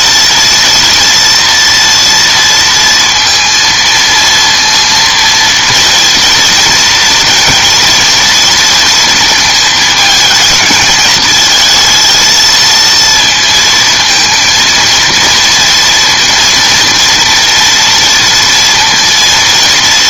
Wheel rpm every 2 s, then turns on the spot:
230, 230, 230, 230, 230, 220, 230, 230, 230, 230.
none